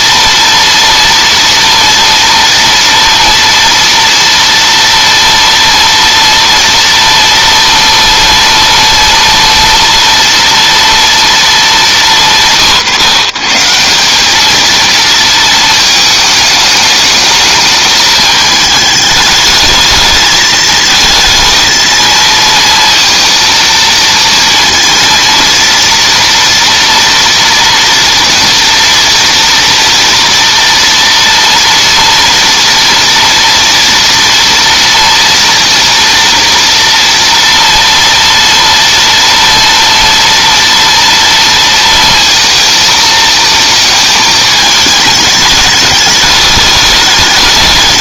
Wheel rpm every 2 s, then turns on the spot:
230, 230, 230, 230, 230, 230, 180, 180, 220, 210, 220, 220, 230, 230, 230, 230, 230, 230, 230, 230, 230, 230, 220, 210.
none